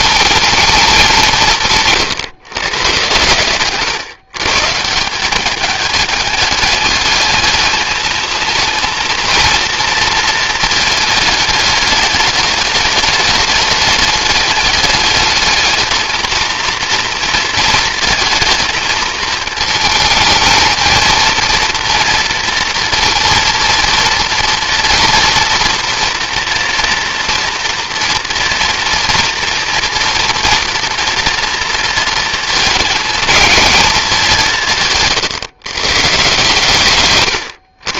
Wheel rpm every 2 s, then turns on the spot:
220, 130, 150, 210, 220, 220, 210, 210, 230, 220, 220, 230, 230, 240, 230, 230, 220, 170, 140.
none